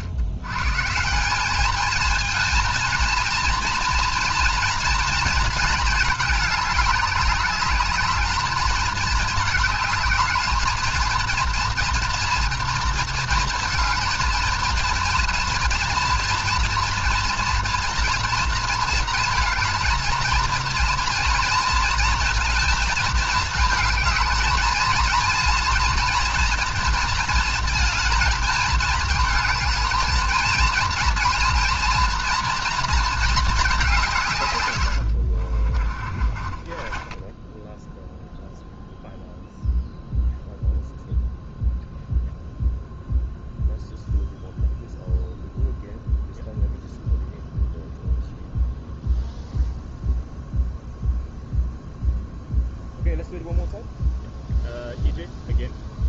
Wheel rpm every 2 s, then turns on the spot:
130, 230, 230, 210, 210, 220, 230, 230, 230, 220, 230, 230, 220, 230, 220, 230, 230, 120, 30, 0, 0, 0, 0, 0, 0, 0, 0, 0.
36-38